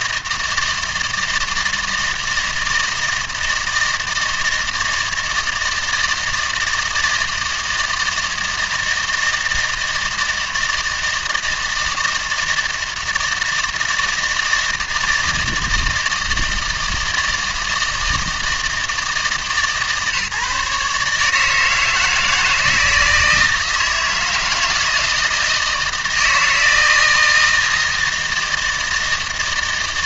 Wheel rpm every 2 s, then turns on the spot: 160, 160, 160, 160, 160, 160, 160, 160, 160, 160, 150, 160, 160, 160, 160.
none